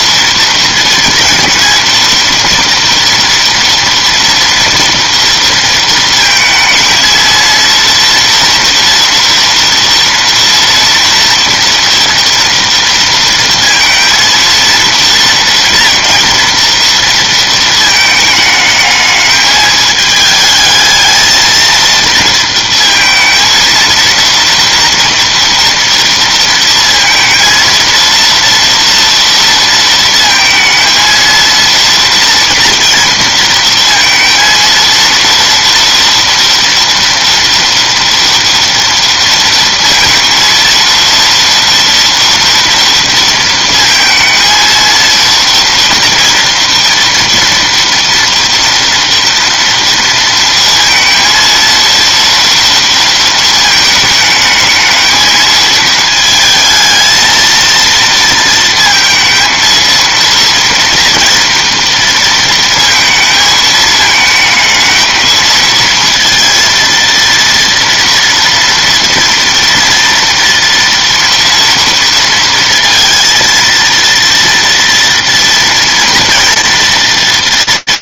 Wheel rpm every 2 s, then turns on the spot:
230, 230, 240, 220, 230, 230, 230, 230, 230, 210, 220, 230, 230, 230, 230, 230, 230, 230, 230, 230, 230, 240, 230, 230, 230, 230, 230, 220, 220, 230, 230, 230, 220, 230, 230, 230, 230, 230, 230.
none